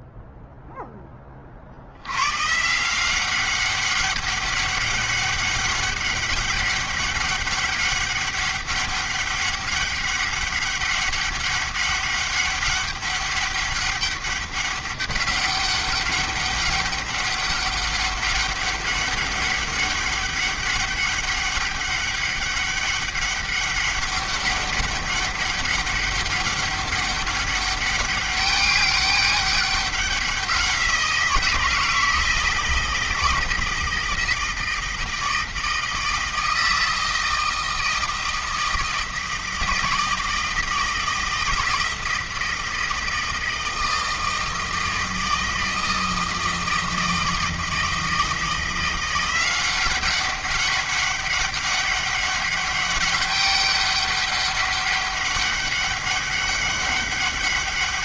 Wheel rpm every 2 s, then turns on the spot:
10, 140, 200, 200, 200, 200, 200, 200, 200, 200, 200, 200, 200, 200, 200, 170, 160, 160, 160, 160, 160, 160, 160, 160, 170, 200, 200, 200, 200.
none